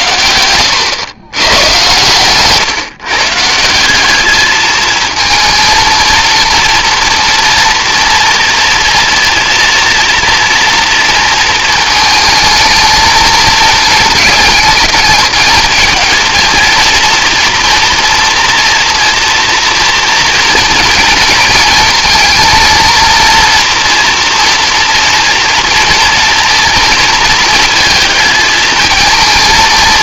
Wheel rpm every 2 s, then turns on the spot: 110, 140, 220, 240, 230, 230, 220, 220, 230, 230, 230, 230, 230, 230, 220.
none